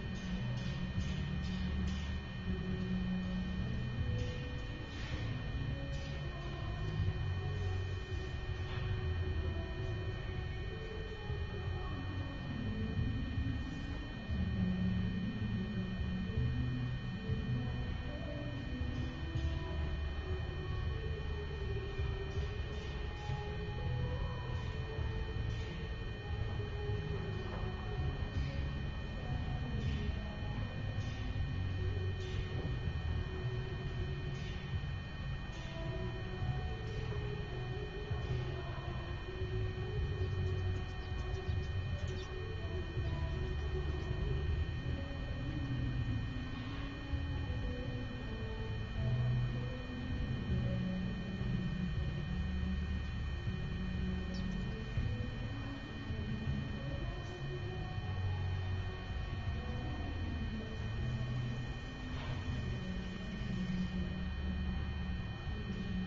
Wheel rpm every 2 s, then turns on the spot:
0, 0, 0, 0, 0, 0, 0, 0, 0, 0, 0, 0, 0, 0, 0, 0, 0, 0, 0, 0, 0, 0, 0, 0, 0, 0, 0, 0, 0, 0, 0, 0, 0.
none